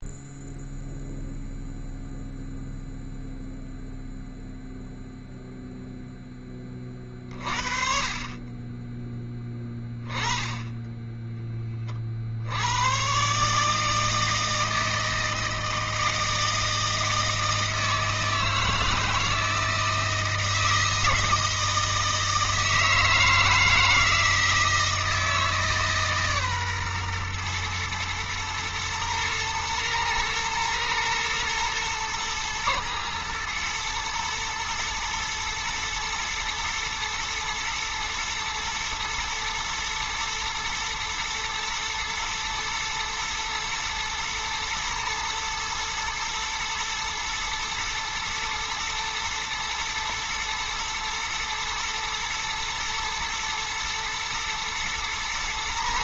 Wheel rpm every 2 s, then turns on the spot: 0, 0, 0, 20, 30, 10, 80, 160, 160, 160, 160, 160, 160, 130, 110, 110, 120, 120, 110, 110, 120, 120, 120, 120, 120, 110, 120, 120.
none